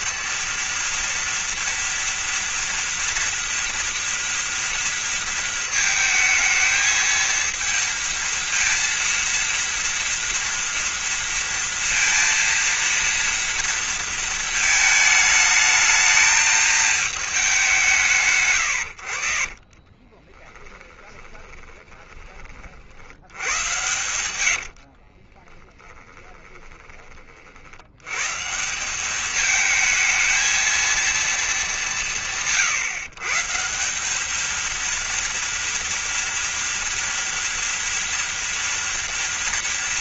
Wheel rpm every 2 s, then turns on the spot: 230, 240, 230, 220, 230, 230, 230, 220, 220, 100, 20, 60, 50, 30, 200, 230, 140, 230, 230, 230.
20-22 24-26